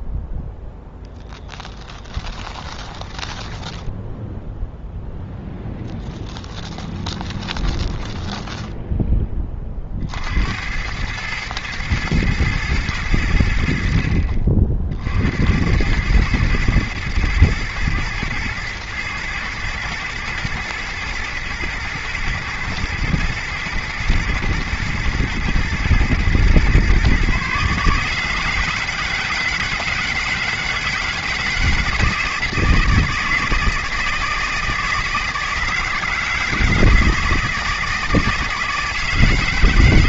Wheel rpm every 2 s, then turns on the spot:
0, 10, 0, 20, 10, 100, 110, 60, 120, 110, 110, 110, 120, 130, 160, 160, 160, 160, 160, 160.
2-4 6-8